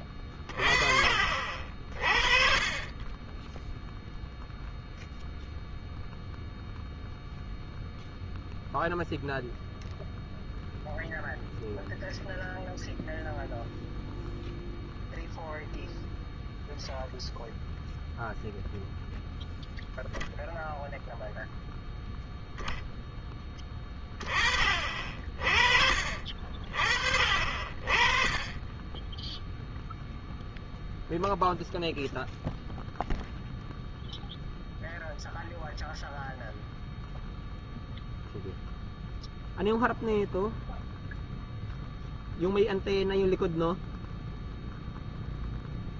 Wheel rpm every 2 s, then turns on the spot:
30, 30, 0, 0, 0, 0, 0, 0, 0, 0, 0, 0, 20, 40, 20, 0, 0, 0, 0, 0, 0, 0, 0.
none